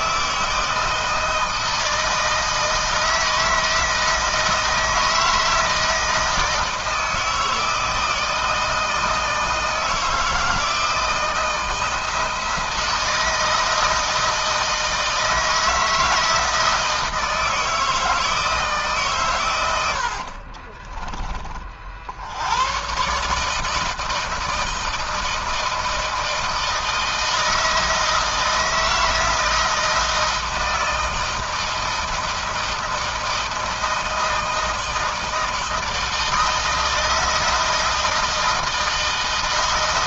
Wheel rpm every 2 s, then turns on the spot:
160, 160, 160, 160, 160, 170, 160, 160, 160, 140, 30, 110, 160, 160, 160, 160, 160, 160, 160, 160.
20-22